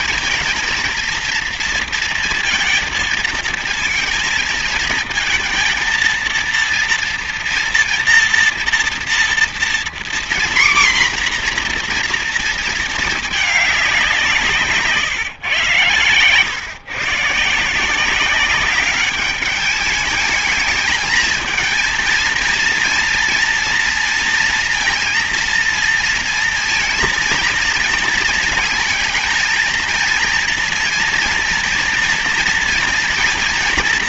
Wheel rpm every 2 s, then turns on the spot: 230, 230, 230, 230, 230, 240, 230, 170, 110, 190, 220, 230, 230, 230, 230, 230, 230.
none